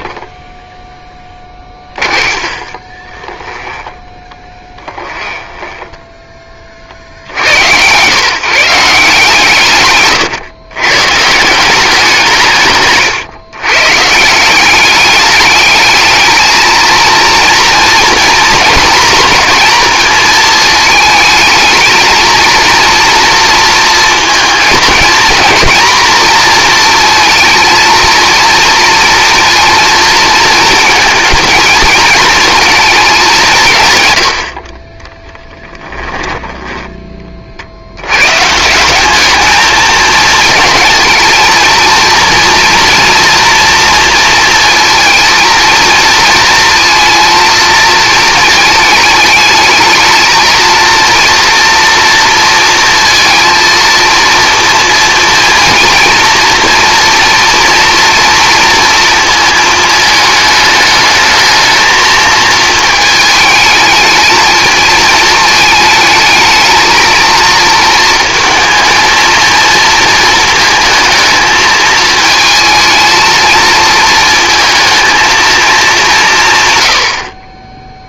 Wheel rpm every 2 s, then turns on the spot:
10, 30, 20, 40, 160, 130, 150, 200, 230, 240, 220, 230, 220, 230, 230, 230, 230, 40, 10, 190, 220, 230, 230, 230, 210, 230, 230, 230, 240, 230, 210, 220, 220, 220, 230, 230, 220, 220, 110.
0-6